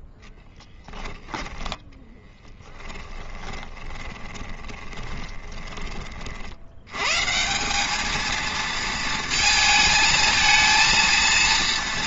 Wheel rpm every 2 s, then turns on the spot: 10, 10, 20, 50, 220, 220.
0-6